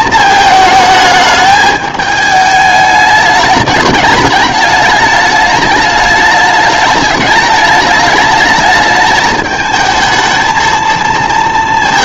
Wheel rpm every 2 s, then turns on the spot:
220, 210, 210, 210, 220, 230.
none